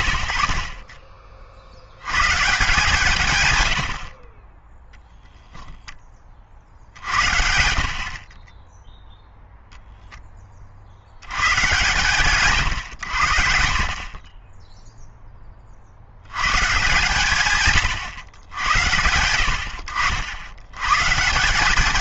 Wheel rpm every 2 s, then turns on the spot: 30, 150, 10, 70, 0, 60, 110, 10, 130, 90, 110.
none